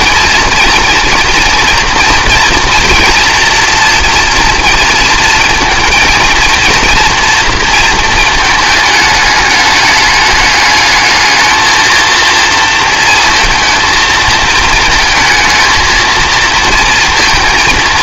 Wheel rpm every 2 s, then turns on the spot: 230, 230, 230, 230, 220, 210, 230, 220, 230.
none